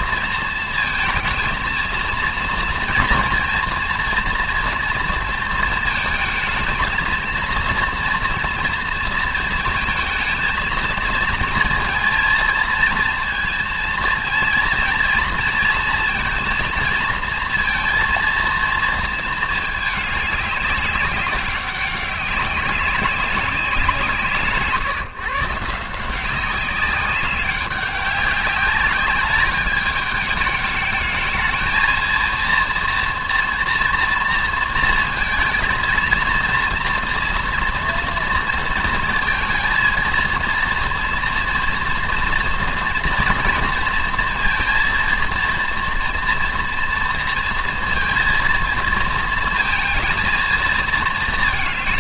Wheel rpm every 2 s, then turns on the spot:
230, 230, 240, 230, 230, 230, 230, 230, 230, 230, 200, 190, 150, 190, 200, 220, 230, 230, 230, 230, 230, 240, 230, 230, 230, 220.
none